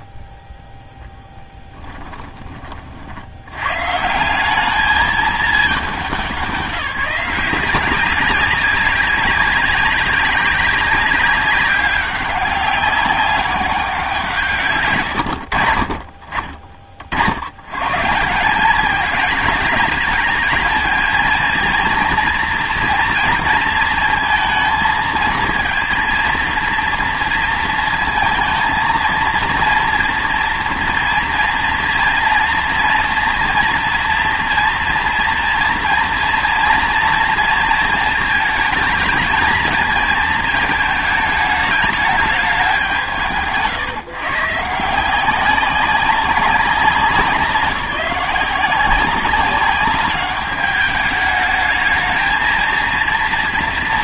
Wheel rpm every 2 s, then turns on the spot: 0, 30, 200, 190, 190, 190, 200, 150, 30, 200, 220, 230, 230, 230, 230, 230, 230, 230, 230, 220, 220, 170, 160, 190, 190, 210, 230.
none